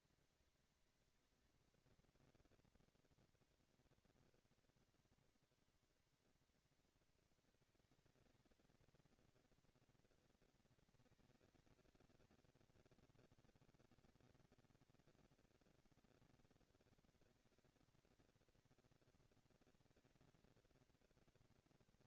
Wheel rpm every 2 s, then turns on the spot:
230, 230, 230, 230, 220, 230, 230, 220, 230, 230, 230.
none